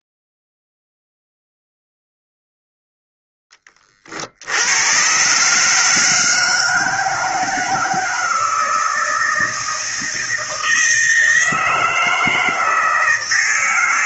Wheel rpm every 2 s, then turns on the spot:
0, 0, 80, 160, 160, 160, 160.
none